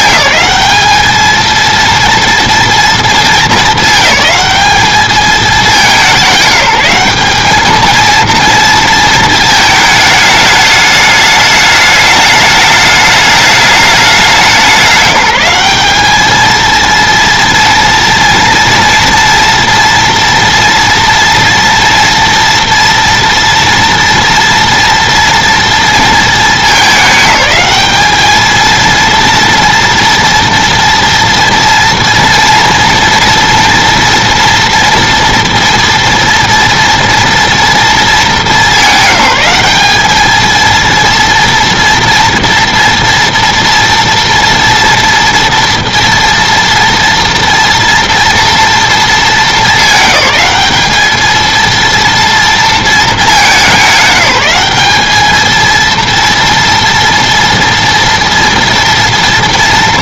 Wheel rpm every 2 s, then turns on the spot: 210, 230, 210, 200, 230, 210, 210, 190, 230, 230, 230, 230, 230, 220, 220, 240, 230, 230, 230, 210, 230, 230, 230, 230, 230, 210, 230, 190, 230, 230.
none